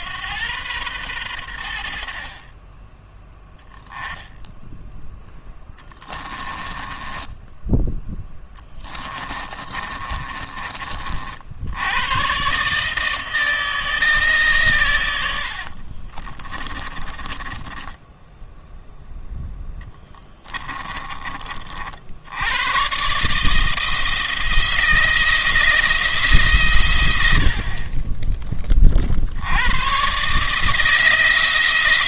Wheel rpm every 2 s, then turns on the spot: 100, 20, 10, 10, 20, 40, 150, 120, 20, 0, 20, 120, 170, 120, 40, 160.
6-10 16-18 20-22